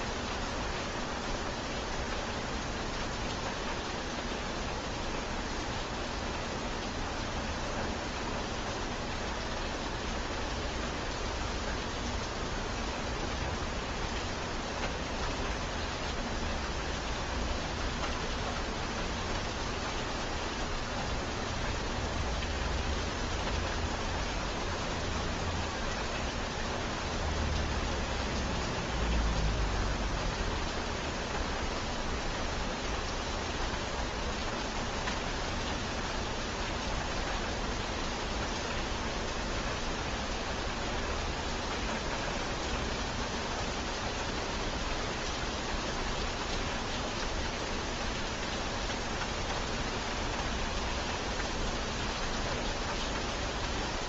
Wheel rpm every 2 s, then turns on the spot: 0, 0, 0, 0, 0, 0, 0, 0, 0, 0, 0, 0, 0, 0, 0, 0, 0, 0, 0, 0, 0, 0, 0, 0, 0, 0, 0.
none